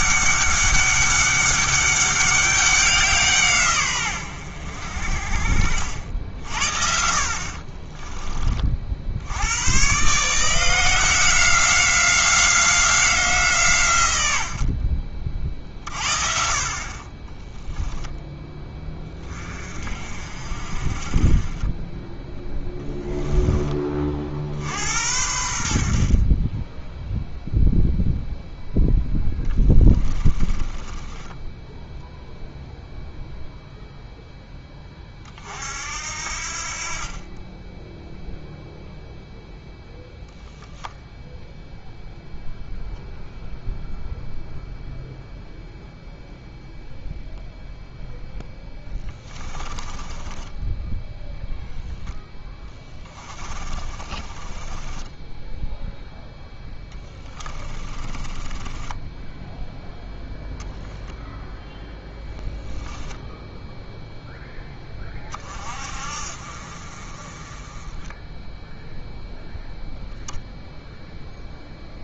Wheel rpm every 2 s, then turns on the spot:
200, 190, 80, 60, 40, 170, 190, 70, 40, 10, 40, 10, 70, 20, 0, 20, 0, 10, 50, 0, 10, 0, 0, 0, 10, 10, 10, 20, 10, 20, 0, 0, 10, 50, 0, 0.
30-32 48-56 58-60